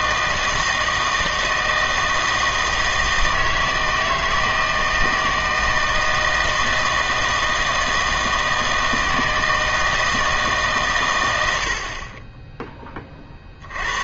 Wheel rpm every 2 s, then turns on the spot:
160, 160, 160, 160, 160, 140, 10.
none